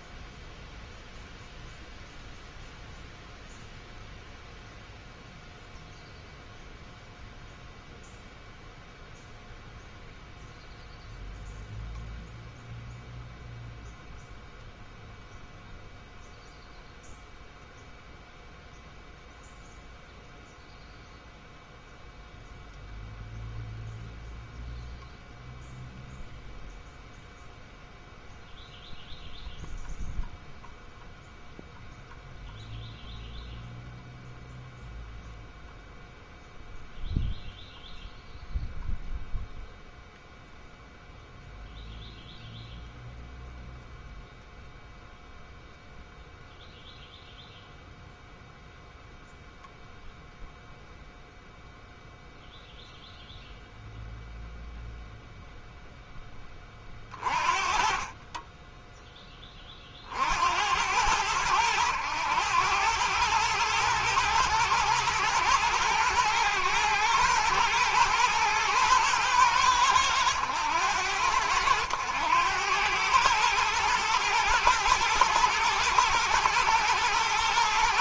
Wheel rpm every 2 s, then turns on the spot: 0, 0, 0, 0, 0, 0, 0, 0, 0, 0, 0, 0, 0, 0, 0, 0, 0, 0, 0, 0, 0, 0, 0, 0, 0, 0, 0, 0, 30, 10, 100, 100, 110, 120, 110, 90, 110, 120, 110.
none